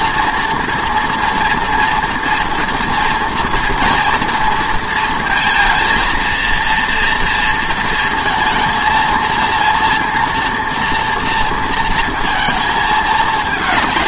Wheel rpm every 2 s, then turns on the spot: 230, 230, 230, 230, 230, 230, 220.
none